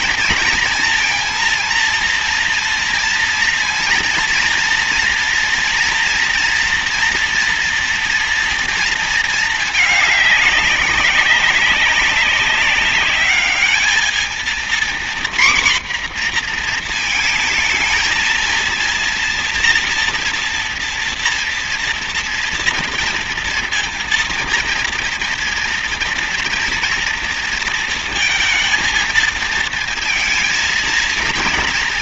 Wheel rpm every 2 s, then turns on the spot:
230, 240, 240, 230, 230, 200, 200, 240, 240, 230, 230, 240, 230, 230, 230, 230.
none